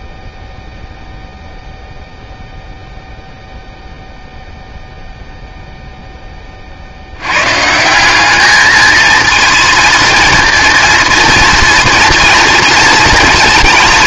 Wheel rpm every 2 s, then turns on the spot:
0, 0, 0, 40, 220, 230, 230.
none